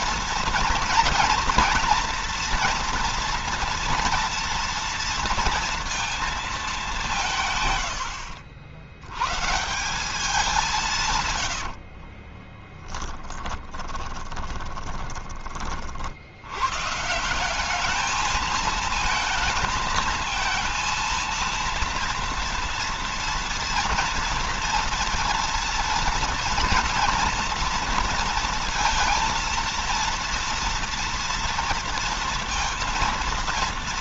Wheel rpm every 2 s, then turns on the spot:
240, 230, 230, 200, 80, 160, 10, 20, 120, 220, 220, 230, 230, 230, 230, 230, 230.
12-16